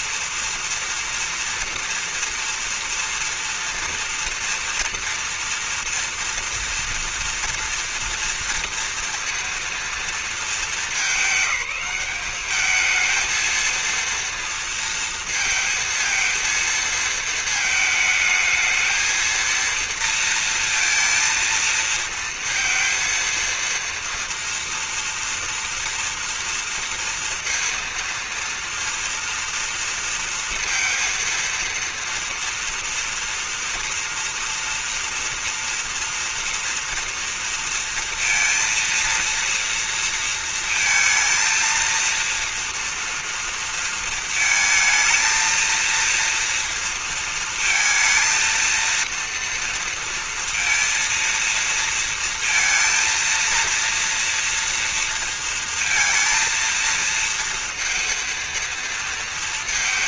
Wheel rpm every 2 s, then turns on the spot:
230, 230, 230, 230, 230, 210, 220, 230, 220, 220, 230, 230, 230, 230, 230, 230, 230, 230, 230, 230, 220, 230, 220, 230, 230, 230, 230, 230, 230, 230.
none